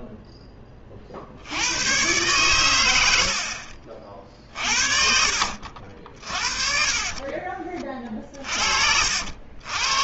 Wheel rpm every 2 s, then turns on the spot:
20, 110, 50, 20, 60.
none